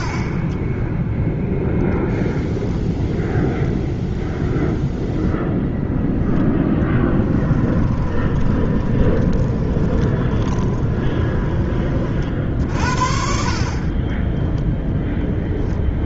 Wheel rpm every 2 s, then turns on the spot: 10, 0, 0, 0, 20, 20, 50, 0.
8-12